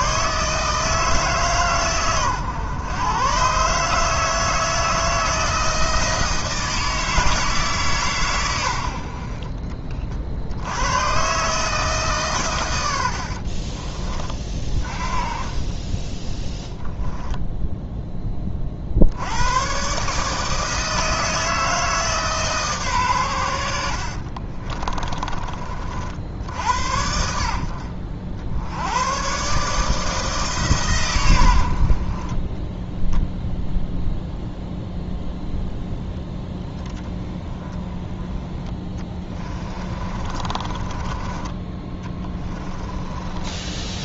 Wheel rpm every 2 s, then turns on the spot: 160, 110, 160, 160, 90, 90, 100, 30, 0, 50, 160, 140, 30, 50, 80, 140, 10, 0, 10, 20, 20, 20.
24-26 38-44